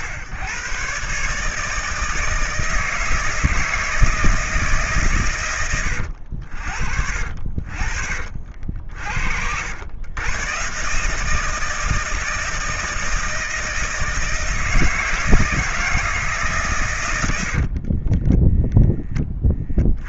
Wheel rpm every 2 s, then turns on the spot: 120, 160, 150, 60, 70, 140, 160, 160, 130, 10.
none